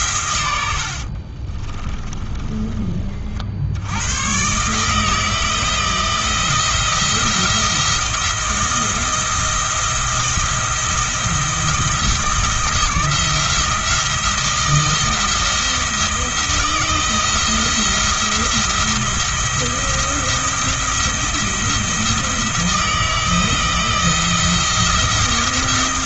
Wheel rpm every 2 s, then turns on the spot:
70, 30, 150, 170, 170, 170, 160, 170, 170, 170, 170, 160, 170.
0-2